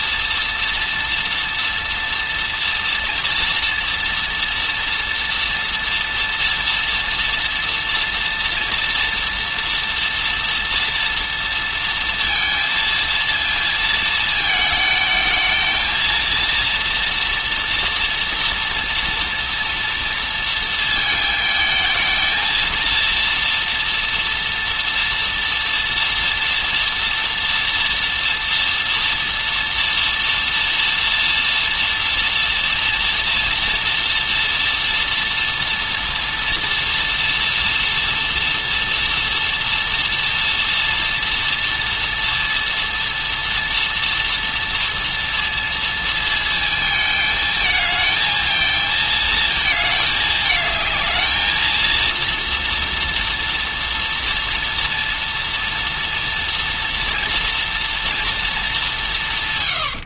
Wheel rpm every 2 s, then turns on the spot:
230, 230, 230, 230, 230, 230, 230, 220, 230, 240, 220, 230, 230, 230, 230, 230, 230, 230, 240, 230, 230, 230, 230, 220, 220, 220, 230, 230, 230, 210.
none